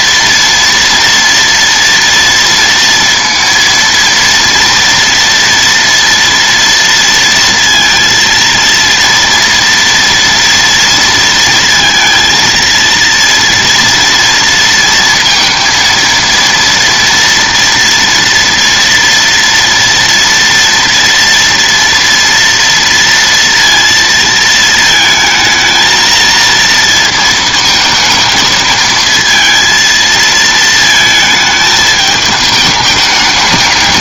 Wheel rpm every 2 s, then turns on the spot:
230, 230, 230, 230, 230, 230, 230, 230, 230, 230, 230, 230, 220, 230, 220, 220, 210.
none